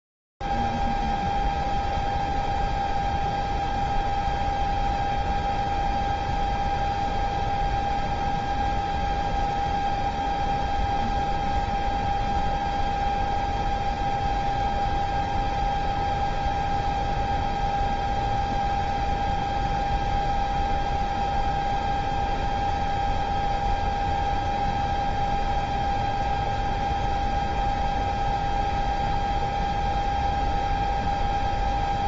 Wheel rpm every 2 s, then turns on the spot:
0, 0, 0, 0, 0, 0, 0, 0, 0, 0, 0, 0, 0, 0, 0, 0.
none